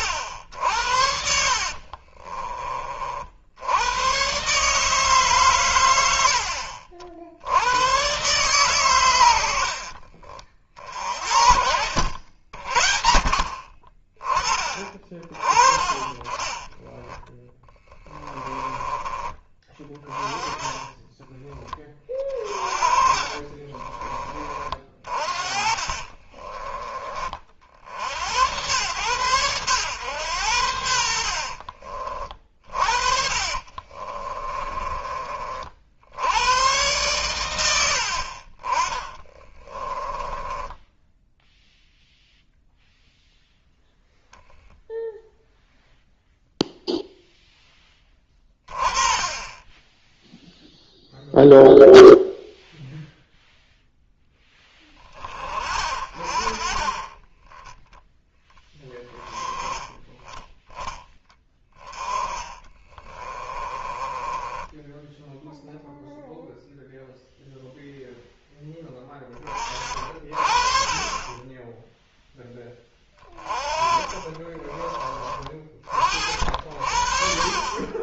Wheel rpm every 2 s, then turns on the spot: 70, 30, 140, 60, 120, 40, 60, 30, 20, 20, 20, 30, 30, 30, 100, 80, 40, 20, 100, 30, 10, 0, 10, 0, 20, 0, 0, 10, 40, 10, 10, 20, 10, 0, 10, 40, 10, 30, 60.
14-16 22-24 32-34 40-42 62-66